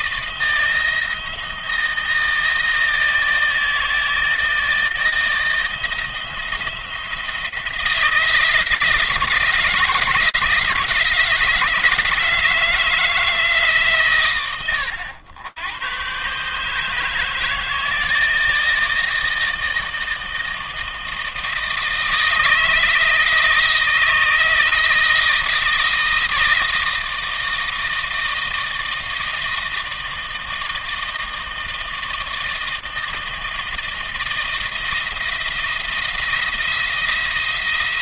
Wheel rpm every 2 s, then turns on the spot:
170, 160, 160, 170, 160, 160, 160, 100, 160, 160, 160, 160, 160, 160, 160, 160, 160, 170, 170.
none